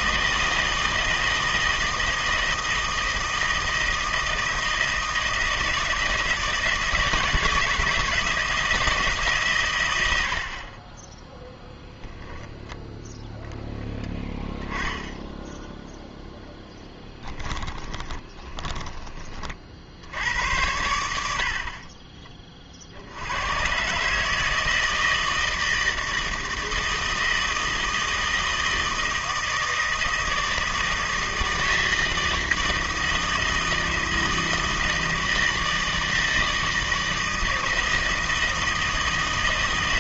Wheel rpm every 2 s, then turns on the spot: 160, 160, 160, 160, 160, 40, 10, 10, 10, 20, 90, 40, 160, 160, 160, 160, 160, 160, 160, 160.
10-12 16-20